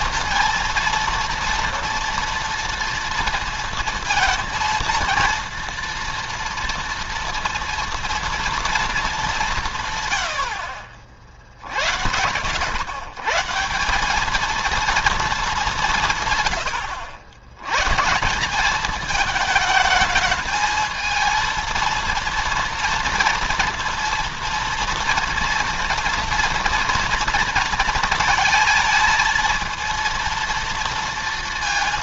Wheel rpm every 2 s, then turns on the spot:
230, 230, 230, 230, 220, 60, 100, 220, 90, 200, 220, 230, 230, 230, 230, 230.
none